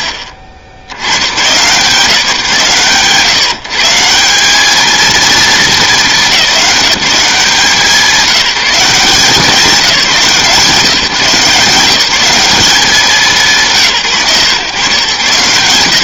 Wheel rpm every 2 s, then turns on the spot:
100, 130, 230, 190, 180, 160, 180, 110.
none